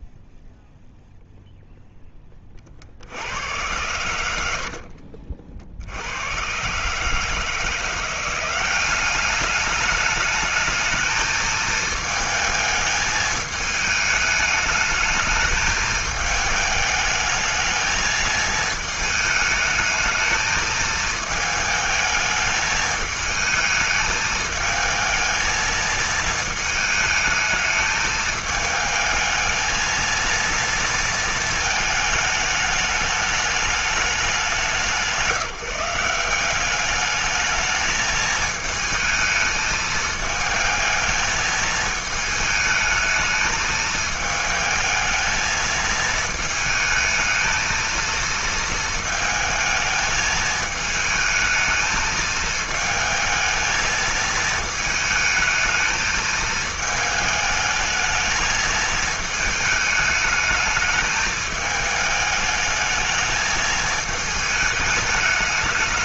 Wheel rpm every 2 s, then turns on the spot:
0, 60, 60, 130, 190, 220, 220, 210, 210, 220, 220, 220, 220, 220, 220, 230, 210, 170, 200, 220, 220, 220, 220, 220, 220, 220, 220, 220, 220, 220, 210, 220, 210.
4-6